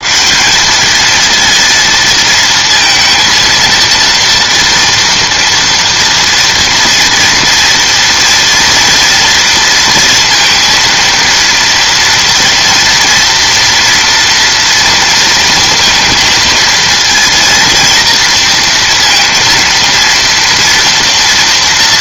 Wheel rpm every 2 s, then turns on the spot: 210, 230, 230, 240, 230, 230, 230, 230, 230, 230, 230.
none